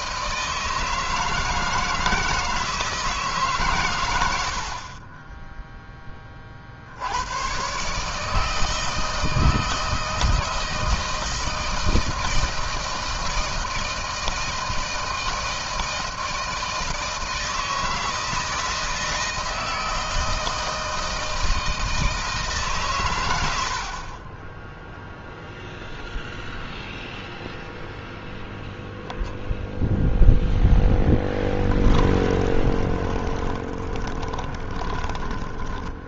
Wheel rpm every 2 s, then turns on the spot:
160, 160, 30, 50, 160, 160, 160, 160, 160, 160, 160, 130, 0, 0, 0, 0, 20, 20.
32-36